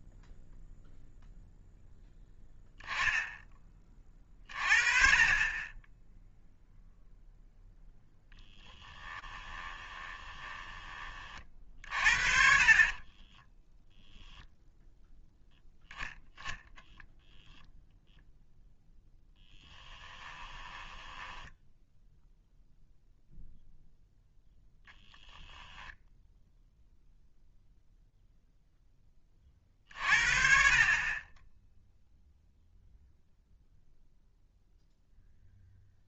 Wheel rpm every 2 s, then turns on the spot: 0, 0, 30, 0, 10, 20, 40, 0, 0, 0, 10, 0, 10, 0, 30, 10, 0, 0.
8-12 20-22 24-26